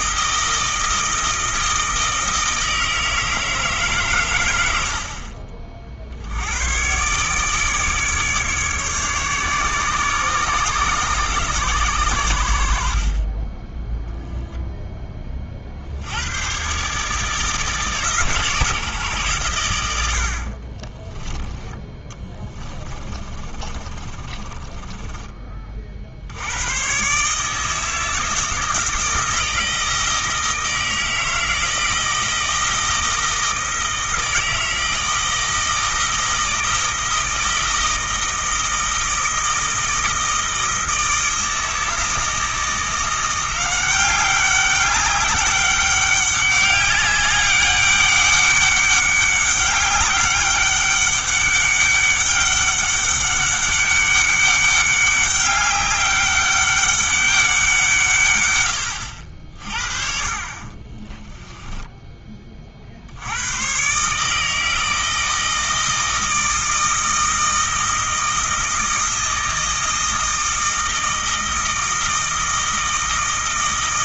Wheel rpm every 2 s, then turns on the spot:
160, 160, 70, 110, 150, 130, 60, 10, 140, 140, 30, 20, 30, 110, 160, 160, 160, 160, 160, 160, 160, 170, 200, 200, 200, 200, 200, 200, 200, 90, 30, 50, 160, 160, 160, 160, 160.
20-26 60-62